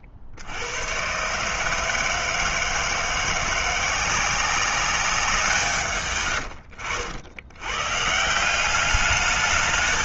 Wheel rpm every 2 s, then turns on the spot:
50, 160, 180, 130, 160.
6-8